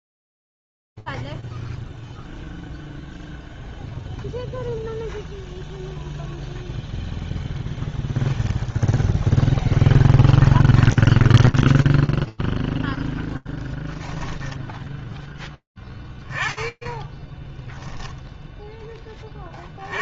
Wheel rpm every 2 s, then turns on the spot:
0, 0, 0, 10, 0, 20, 0, 10, 10, 10.
10-12